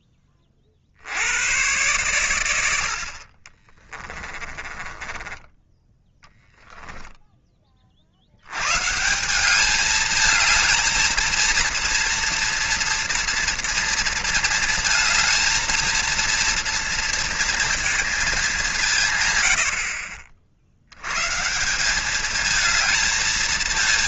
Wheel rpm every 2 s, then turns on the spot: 30, 70, 20, 10, 140, 220, 230, 230, 230, 130, 80, 220.
4-6